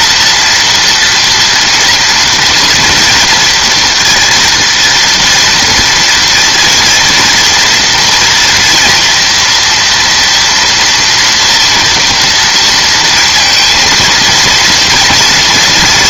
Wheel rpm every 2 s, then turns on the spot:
230, 240, 230, 230, 240, 230, 230, 230.
none